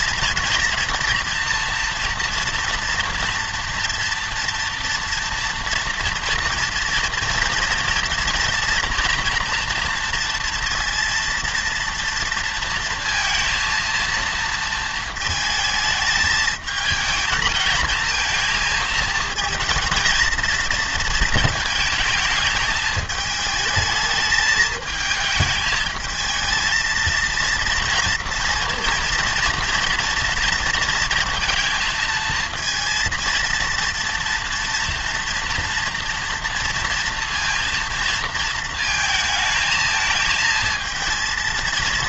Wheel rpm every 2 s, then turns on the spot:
230, 230, 240, 240, 240, 230, 230, 230, 220, 220, 230, 220, 220, 220, 230, 230, 230, 230, 230, 220, 220.
none